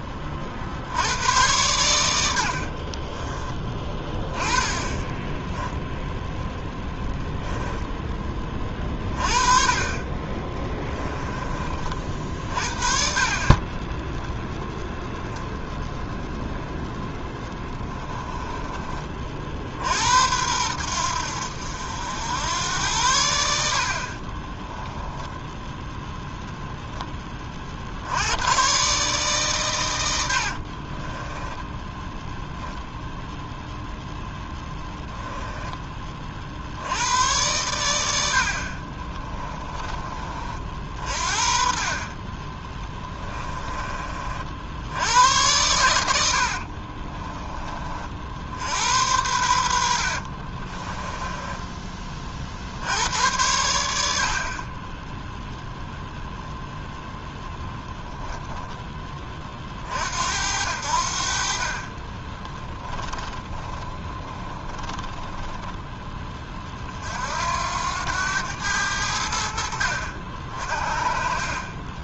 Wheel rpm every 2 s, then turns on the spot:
70, 60, 20, 10, 20, 10, 50, 0, 0, 20, 90, 90, 20, 10, 130, 50, 0, 10, 80, 50, 50, 20, 70, 50, 90, 20, 70, 30, 0, 10, 70, 10, 20, 40, 80, 50.
2-6 10-12 18-20 24-28 30-32 38-40 42-44 46-48 50-52 62-66